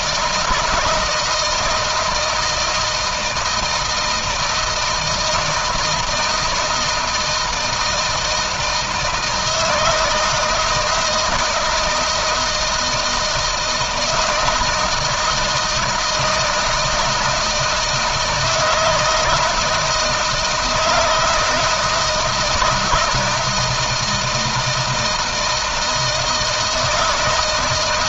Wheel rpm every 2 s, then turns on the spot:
160, 160, 160, 160, 160, 160, 160, 160, 160, 160, 160, 170, 160, 160.
none